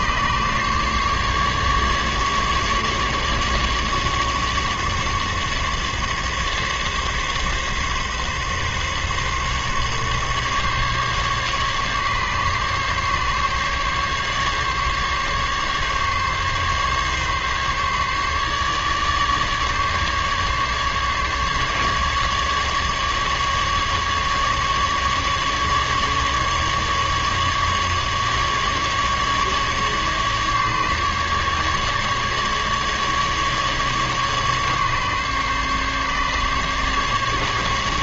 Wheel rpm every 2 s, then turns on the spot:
140, 150, 150, 140, 140, 140, 140, 140, 140, 150, 150, 150, 150, 150, 140, 140, 140, 140, 140.
none